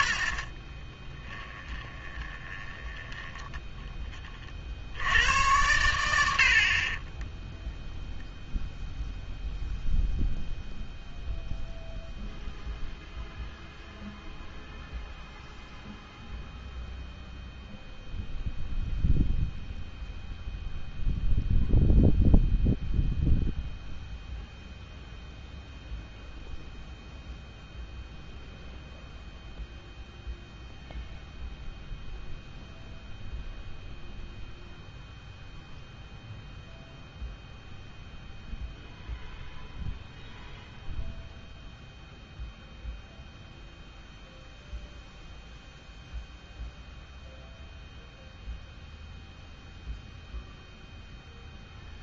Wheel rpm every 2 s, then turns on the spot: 40, 20, 40, 30, 0, 0, 0, 0, 0, 0, 0, 0, 0, 0, 0, 0, 0, 0, 0, 0, 0, 0, 0, 0, 0, 0.
0-4 6-8